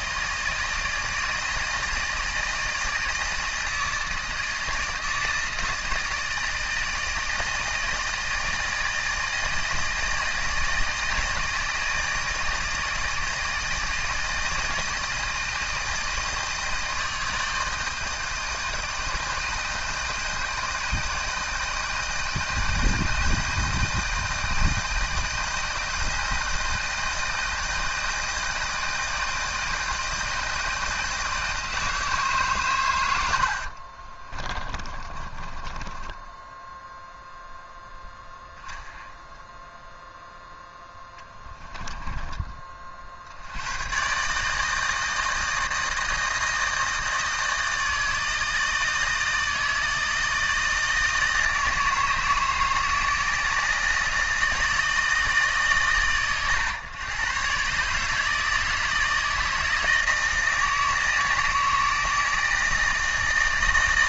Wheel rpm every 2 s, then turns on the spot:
160, 160, 160, 160, 160, 160, 160, 160, 160, 160, 160, 160, 160, 160, 160, 160, 140, 30, 10, 0, 0, 20, 150, 160, 160, 160, 160, 160, 120, 160, 160, 160.
34-38